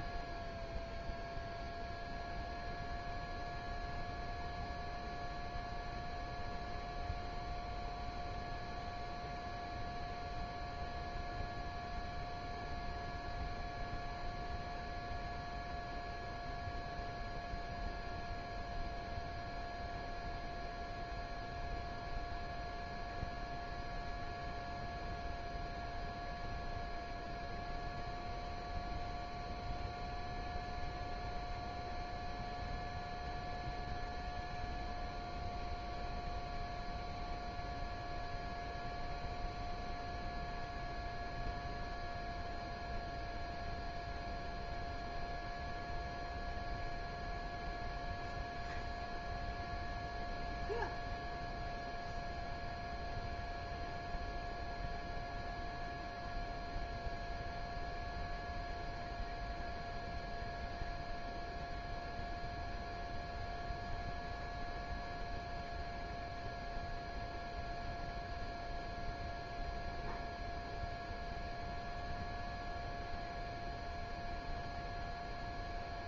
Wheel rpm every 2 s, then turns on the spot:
0, 0, 0, 0, 0, 0, 0, 0, 0, 0, 0, 0, 0, 0, 0, 0, 0, 0, 0, 0, 0, 0, 0, 0, 0, 0, 0, 0, 0, 0, 0, 0, 0, 0, 0, 0, 0, 0.
none